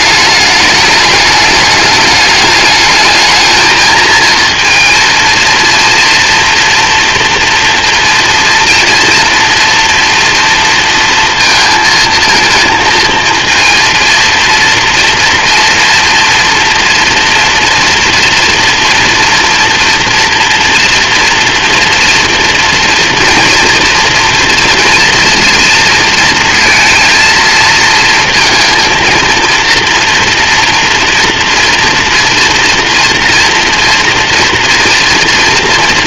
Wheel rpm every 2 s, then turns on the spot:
210, 220, 230, 230, 230, 230, 230, 230, 230, 230, 240, 230, 240, 230, 230, 230, 230, 230.
none